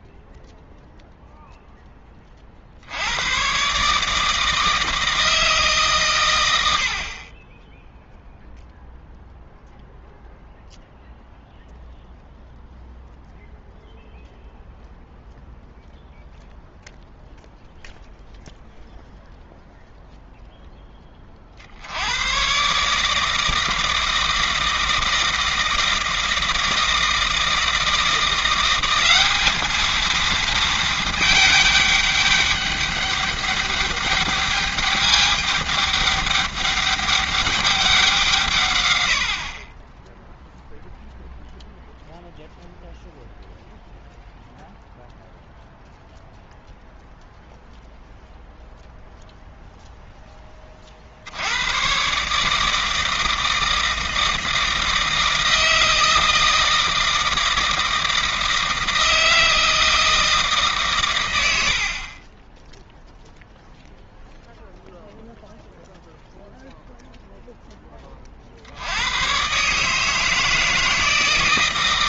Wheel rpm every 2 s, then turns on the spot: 0, 60, 160, 80, 0, 0, 0, 0, 0, 0, 10, 140, 160, 160, 190, 220, 200, 210, 200, 130, 0, 0, 0, 0, 0, 40, 160, 160, 160, 160, 140, 0, 0, 0, 70, 160.
none